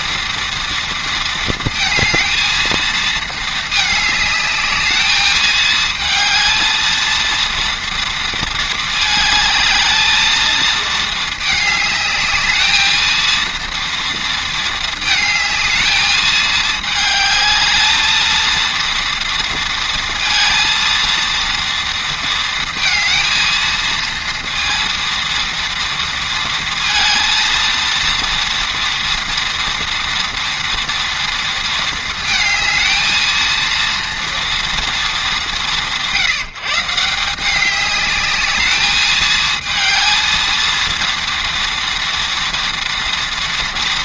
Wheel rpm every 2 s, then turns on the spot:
230, 230, 220, 230, 220, 220, 220, 220, 220, 230, 230, 230, 230, 230, 230, 230, 220, 210, 160, 210, 230, 230.
none